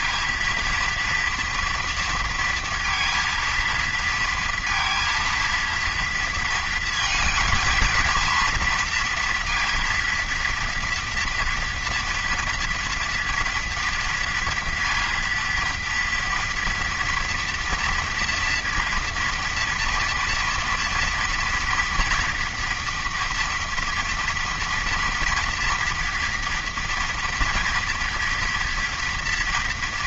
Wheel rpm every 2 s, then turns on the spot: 230, 230, 230, 230, 230, 230, 230, 230, 230, 240, 230, 230, 240, 230, 240.
none